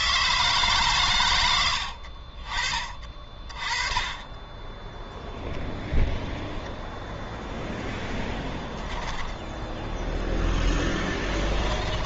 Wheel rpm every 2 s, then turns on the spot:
140, 40, 10, 0, 10, 10.
8-10